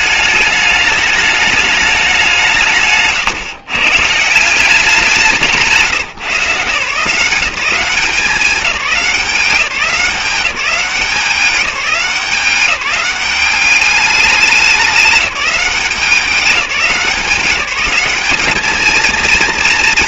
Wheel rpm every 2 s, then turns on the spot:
210, 170, 180, 160, 190, 190, 190, 200, 190, 210.
none